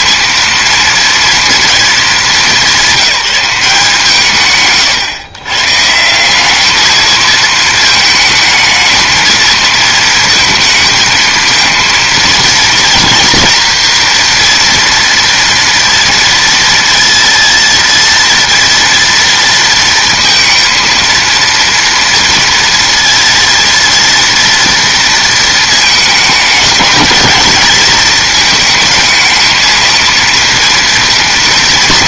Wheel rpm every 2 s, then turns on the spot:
230, 180, 130, 200, 220, 220, 230, 230, 230, 230, 230, 230, 230, 210, 220, 230.
none